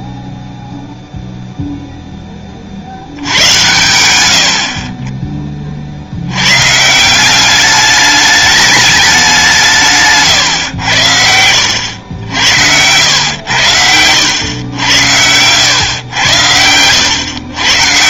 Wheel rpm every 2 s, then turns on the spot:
0, 70, 30, 150, 210, 90, 100, 100, 100.
none